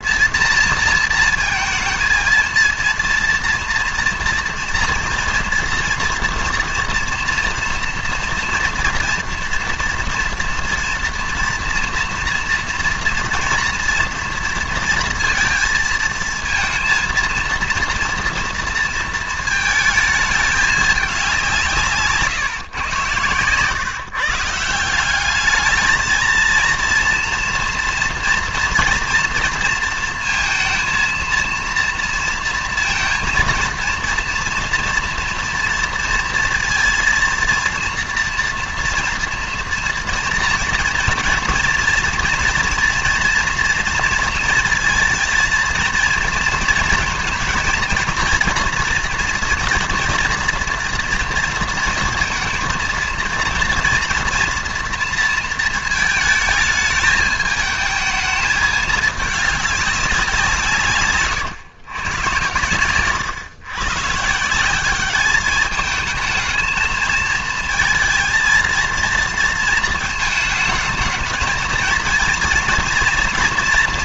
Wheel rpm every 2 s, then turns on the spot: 230, 230, 230, 230, 230, 230, 230, 230, 230, 230, 210, 130, 170, 230, 230, 230, 230, 230, 230, 230, 230, 230, 230, 230, 230, 240, 230, 230, 220, 210, 160, 110, 180, 220, 230, 220, 230.
none